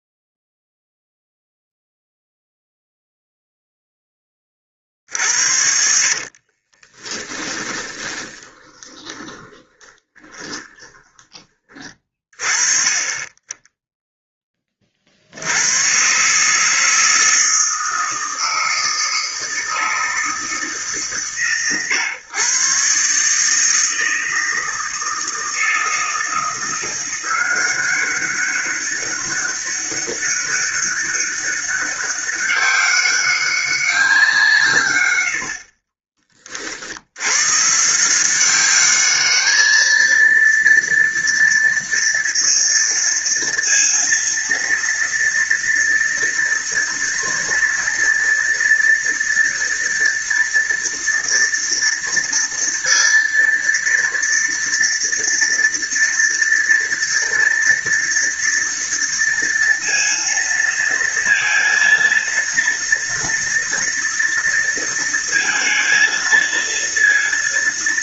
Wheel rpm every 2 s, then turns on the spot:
0, 0, 30, 40, 20, 20, 30, 30, 150, 160, 160, 130, 160, 170, 190, 200, 200, 150, 40, 190, 230, 230, 230, 230, 230, 230, 230, 230, 230, 230, 230, 230, 230, 230.
6-12